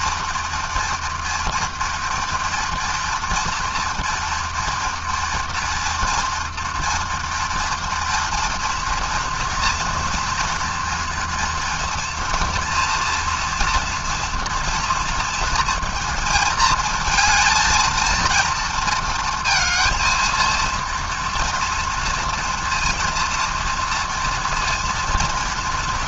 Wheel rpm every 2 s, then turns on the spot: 230, 230, 230, 230, 240, 230, 230, 230, 220, 230, 230, 230, 230.
none